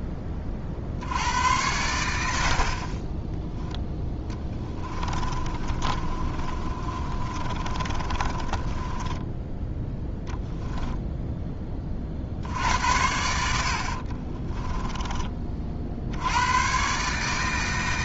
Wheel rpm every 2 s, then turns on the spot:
60, 50, 20, 30, 20, 10, 80, 20, 120.
4-10 14-16